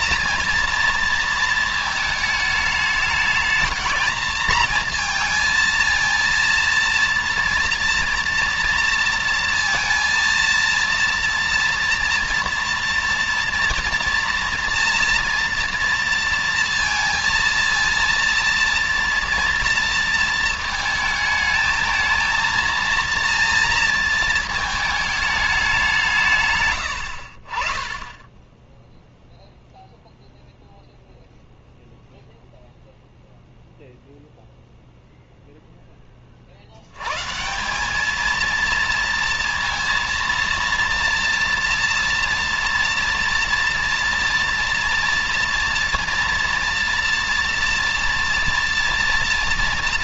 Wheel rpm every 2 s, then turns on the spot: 230, 220, 220, 230, 230, 230, 230, 230, 230, 230, 230, 230, 220, 150, 10, 0, 0, 0, 30, 220, 230, 230, 230, 230, 230.
none